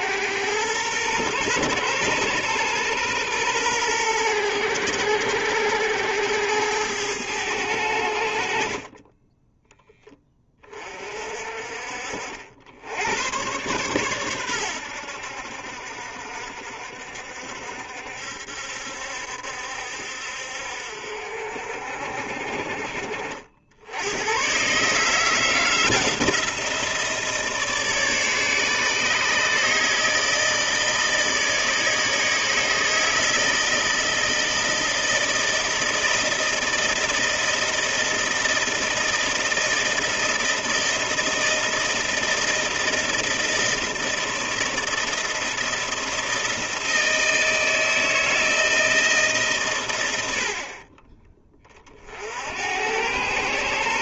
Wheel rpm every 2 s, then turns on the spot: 110, 120, 100, 100, 40, 30, 90, 90, 60, 70, 60, 40, 140, 170, 150, 160, 160, 160, 160, 160, 160, 160, 170, 160, 160, 40, 100.
none